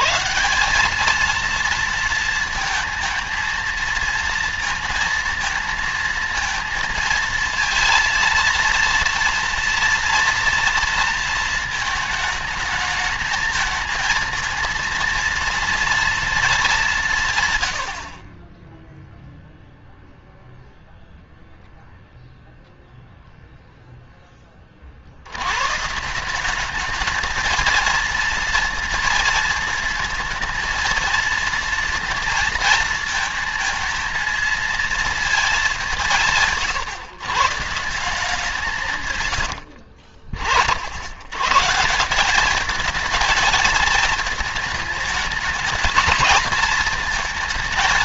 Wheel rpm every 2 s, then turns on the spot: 160, 230, 230, 230, 230, 230, 220, 230, 220, 20, 0, 0, 20, 180, 230, 230, 230, 230, 160, 180, 80, 200, 220, 230.
none